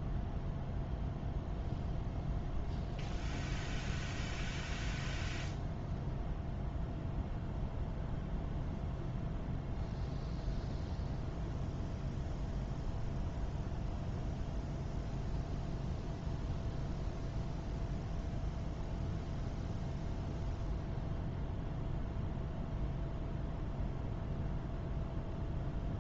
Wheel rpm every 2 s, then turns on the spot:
0, 0, 0, 0, 0, 0, 0, 0, 0, 0, 0, 0, 0.
none